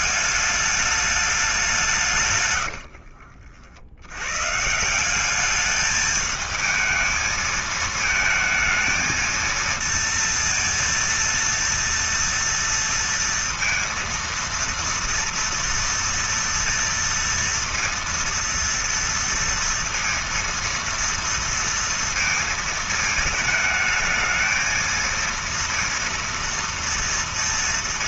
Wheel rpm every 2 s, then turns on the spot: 210, 60, 180, 220, 230, 230, 230, 230, 230, 230, 230, 220, 230, 230.
2-4